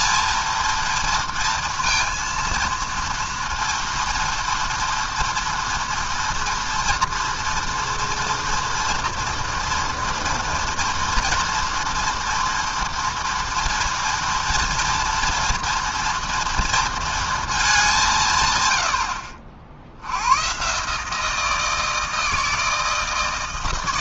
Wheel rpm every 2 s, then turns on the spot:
230, 230, 230, 230, 230, 240, 240, 230, 230, 100, 140, 160.
none